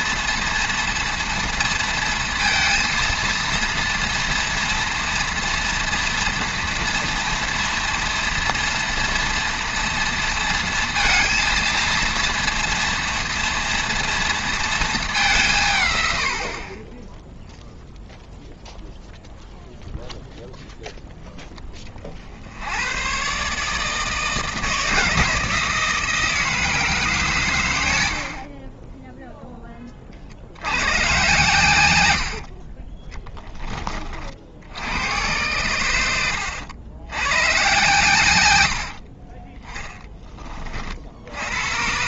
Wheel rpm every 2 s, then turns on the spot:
230, 230, 230, 230, 230, 230, 230, 210, 20, 0, 0, 110, 160, 150, 20, 110, 20, 90, 100, 70, 60.
28-30 32-34 38-40